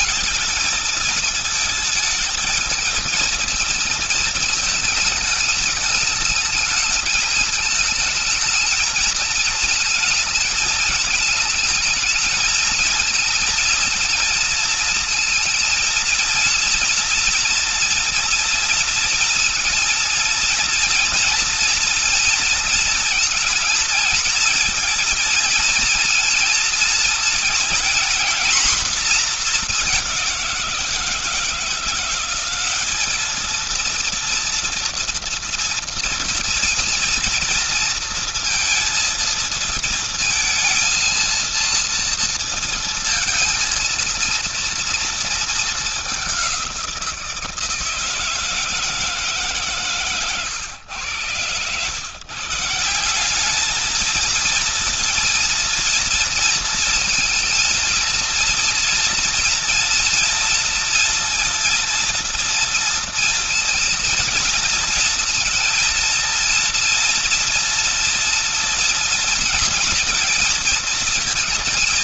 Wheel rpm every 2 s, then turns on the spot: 220, 220, 220, 220, 220, 220, 220, 230, 230, 230, 230, 230, 230, 230, 240, 180, 190, 230, 230, 230, 230, 230, 230, 180, 160, 120, 150, 230, 230, 230, 230, 230, 230, 230, 230, 230.
none